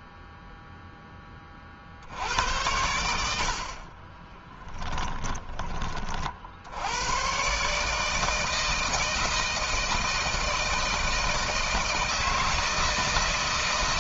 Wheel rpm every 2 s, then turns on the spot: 0, 90, 20, 60, 160, 160, 160.
4-6